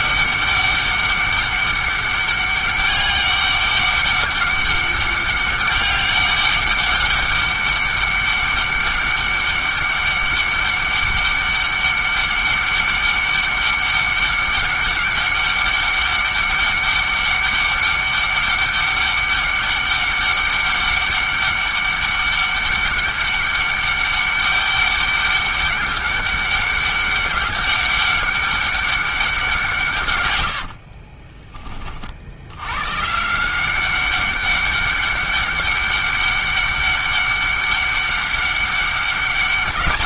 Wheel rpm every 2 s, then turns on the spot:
200, 200, 200, 200, 200, 200, 200, 200, 200, 200, 200, 200, 200, 200, 200, 50, 110, 190, 200, 200.
30-32